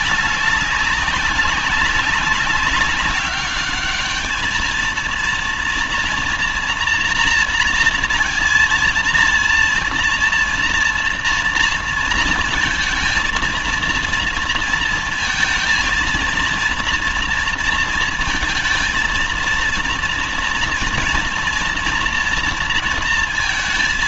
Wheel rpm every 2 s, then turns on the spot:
200, 190, 220, 240, 230, 230, 230, 230, 230, 230, 230, 230.
none